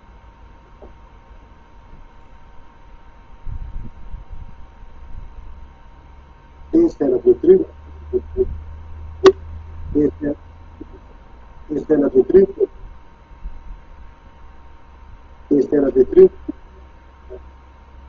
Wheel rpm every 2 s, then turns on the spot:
0, 0, 0, 0, 0, 0, 0, 0, 0.
none